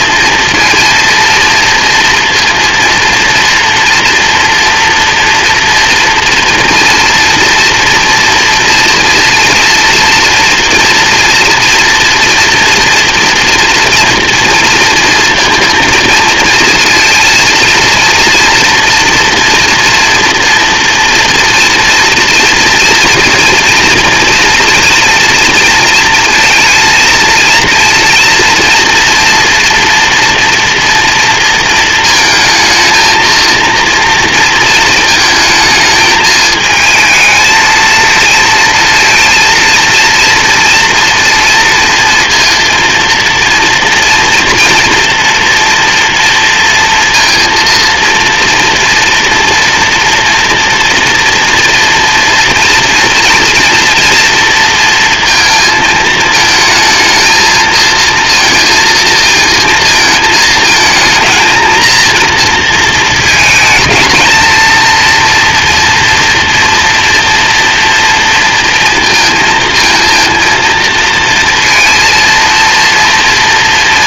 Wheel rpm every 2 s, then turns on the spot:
230, 230, 230, 230, 230, 230, 240, 240, 230, 230, 230, 230, 230, 230, 230, 240, 220, 230, 220, 230, 230, 230, 230, 230, 240, 230, 230, 230, 220, 230, 220, 230, 220, 230, 230, 230, 230.
none